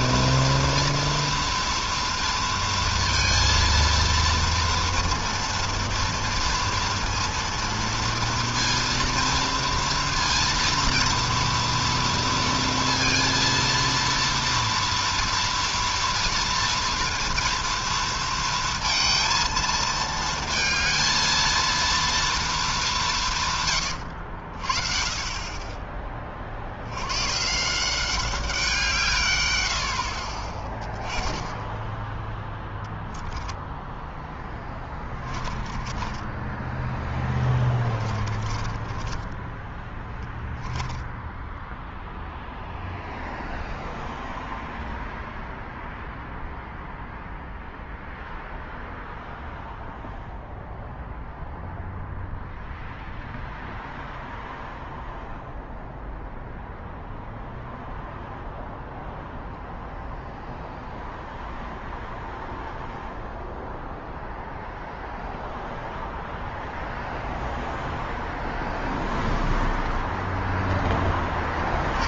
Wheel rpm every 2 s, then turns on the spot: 230, 230, 240, 230, 230, 230, 230, 230, 230, 230, 230, 160, 30, 130, 120, 10, 10, 20, 10, 20, 10, 0, 0, 0, 0, 0, 0, 0, 0, 0, 0, 0, 0, 0, 0, 10.
32-42